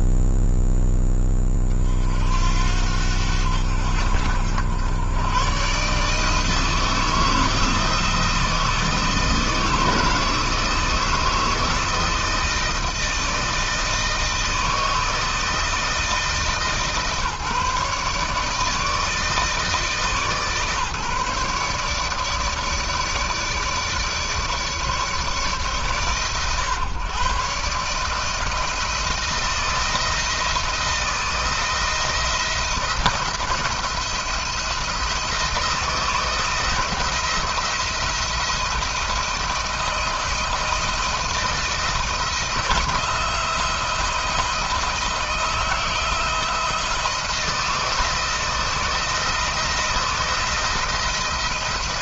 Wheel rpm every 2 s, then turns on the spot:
10, 70, 70, 160, 160, 160, 160, 160, 150, 150, 150, 150, 150, 140, 160, 160, 170, 160, 160, 170, 170, 170, 170, 170, 170, 170.
none